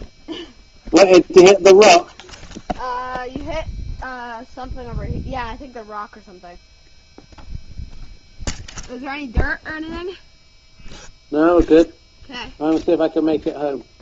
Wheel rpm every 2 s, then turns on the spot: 0, 0, 0, 0, 0, 0, 0.
none